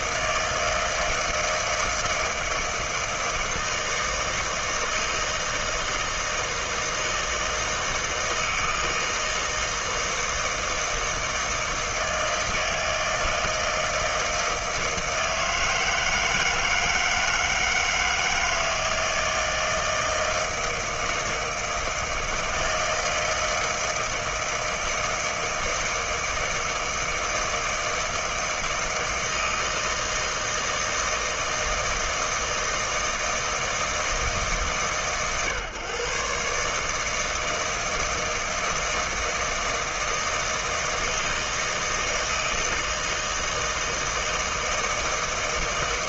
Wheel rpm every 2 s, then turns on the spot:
160, 160, 160, 160, 160, 160, 160, 160, 160, 160, 160, 160, 160, 160, 160, 160, 160, 140, 130, 160, 160, 160, 160.
none